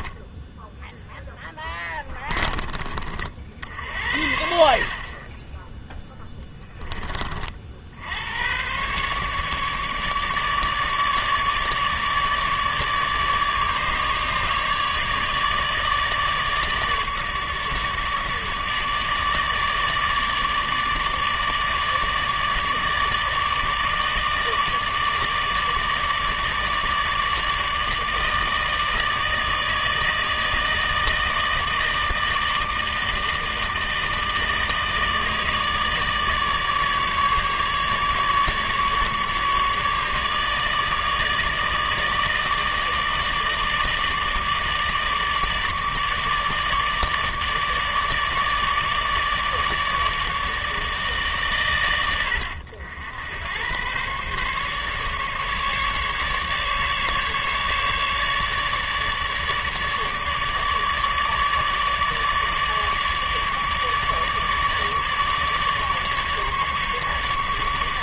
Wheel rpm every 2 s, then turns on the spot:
10, 40, 40, 20, 130, 150, 150, 150, 150, 150, 150, 150, 150, 150, 160, 160, 160, 160, 150, 150, 150, 160, 150, 150, 150, 150, 80, 140, 150, 150, 150, 150, 150, 150.
0-2